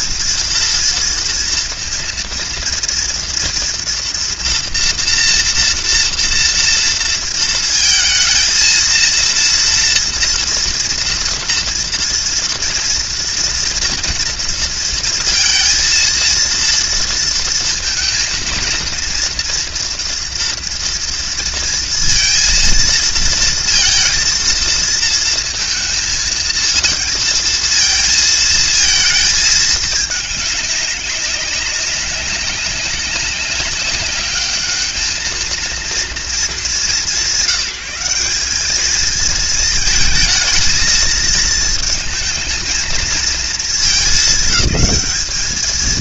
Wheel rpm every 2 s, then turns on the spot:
230, 230, 240, 230, 220, 230, 230, 230, 230, 230, 230, 230, 230, 220, 230, 210, 200, 210, 210, 200, 220, 220, 210.
none